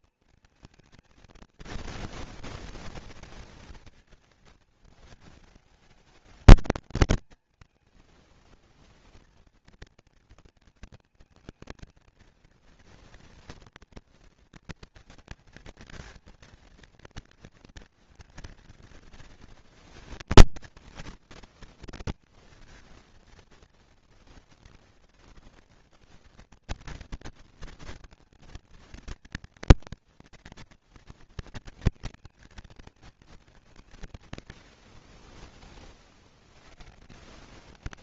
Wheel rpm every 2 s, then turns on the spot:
230, 230, 220, 220, 230, 230, 230, 230, 230, 230, 230, 230, 230, 230, 220, 230, 210, 30, 160.
none